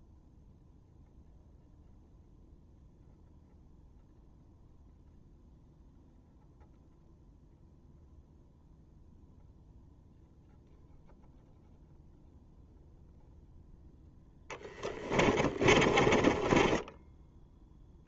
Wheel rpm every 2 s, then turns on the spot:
0, 0, 0, 0, 0, 0, 0, 20, 10.
14-18